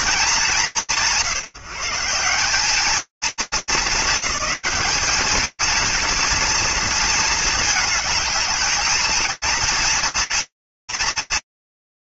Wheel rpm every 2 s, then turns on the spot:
170, 200, 190, 230, 220, 220.
none